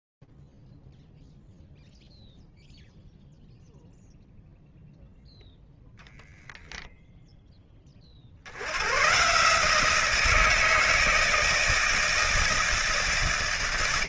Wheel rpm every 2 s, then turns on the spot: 0, 0, 0, 10, 60, 170, 160.
none